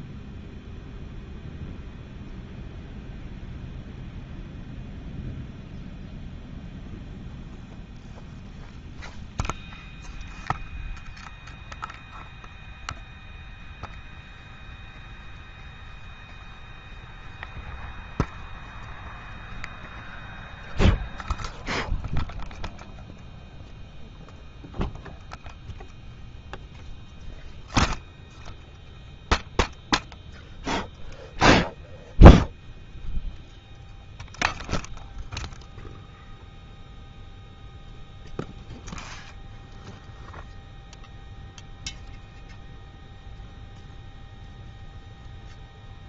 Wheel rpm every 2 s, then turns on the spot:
0, 0, 0, 0, 0, 0, 0, 0, 0, 0, 0, 0, 0, 0, 0, 0, 0, 0, 0, 0, 0, 0, 0.
none